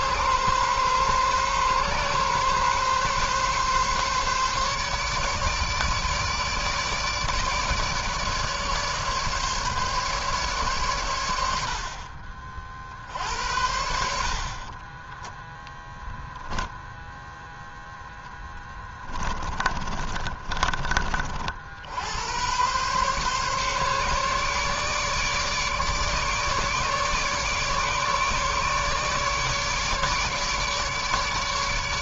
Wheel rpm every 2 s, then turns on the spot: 130, 130, 140, 150, 150, 140, 50, 50, 0, 10, 30, 100, 140, 150, 150, 150.
14-16 18-22